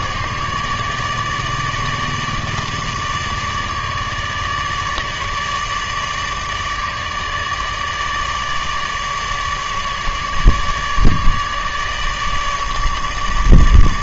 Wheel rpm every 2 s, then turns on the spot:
150, 150, 150, 150, 150, 150, 150.
none